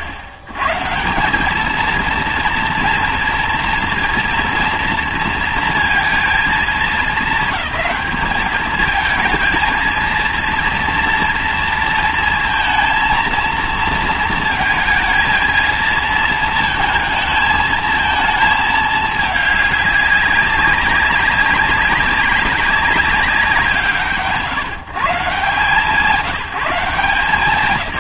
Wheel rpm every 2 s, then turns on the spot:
120, 230, 230, 210, 220, 230, 230, 230, 220, 220, 200, 200, 120, 180.
none